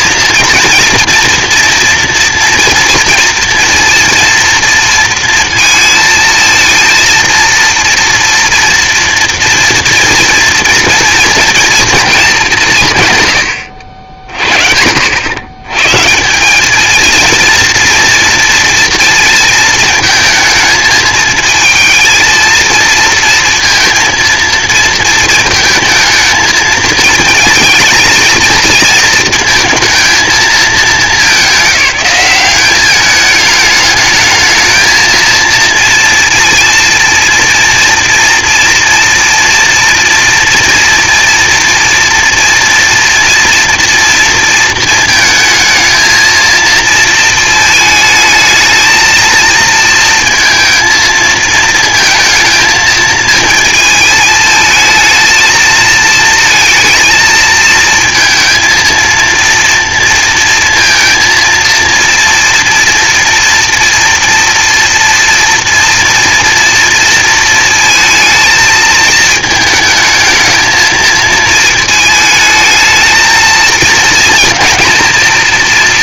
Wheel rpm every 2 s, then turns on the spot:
230, 230, 230, 230, 230, 230, 180, 60, 210, 230, 220, 230, 230, 220, 230, 210, 200, 220, 230, 230, 230, 240, 230, 230, 220, 230, 230, 220, 230, 230, 230, 230, 230, 230, 220, 220, 220, 240.
none